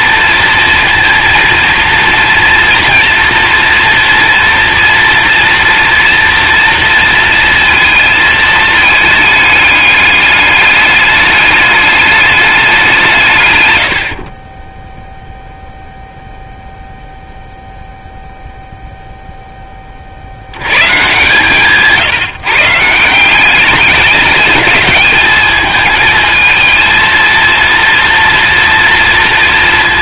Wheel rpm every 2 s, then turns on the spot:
230, 230, 240, 230, 220, 210, 170, 10, 0, 0, 120, 160, 210, 230, 230.
none